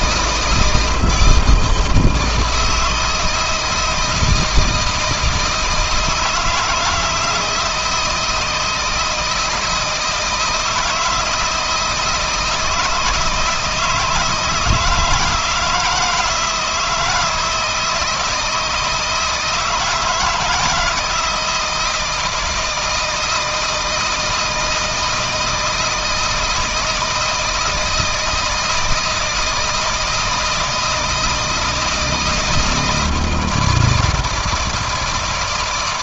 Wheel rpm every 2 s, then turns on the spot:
160, 160, 160, 160, 160, 160, 160, 170, 160, 160, 160, 160, 160, 160, 160, 160, 160, 160.
none